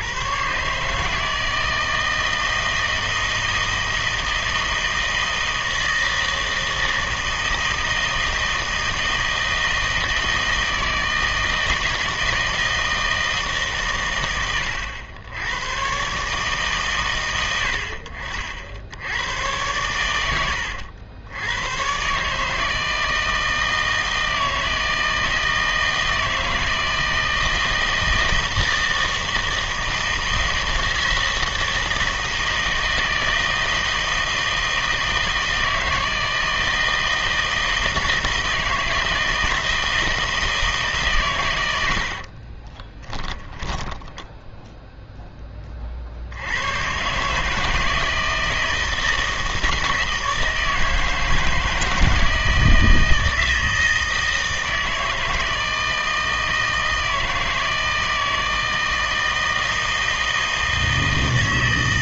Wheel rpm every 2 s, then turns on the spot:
140, 160, 160, 160, 160, 160, 160, 100, 140, 70, 90, 160, 160, 160, 160, 160, 160, 160, 160, 160, 160, 20, 0, 100, 160, 160, 160, 160, 160, 160, 160.
42-44